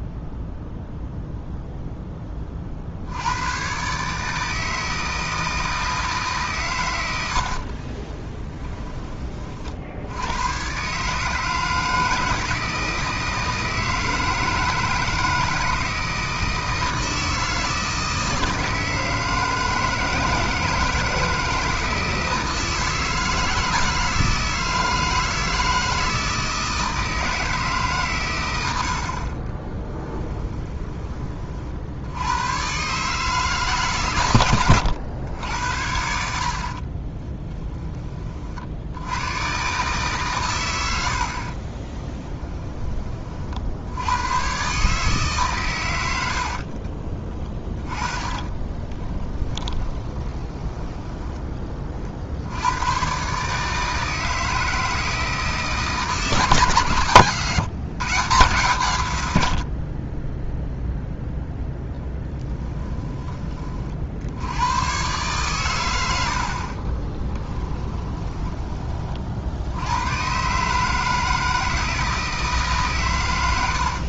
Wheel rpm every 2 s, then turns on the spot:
0, 60, 160, 110, 20, 140, 160, 160, 160, 160, 160, 160, 160, 160, 80, 20, 130, 90, 40, 70, 90, 20, 140, 50, 10, 10, 90, 160, 140, 120, 0, 10, 110, 30, 30, 140, 150.
36-38 46-52 66-68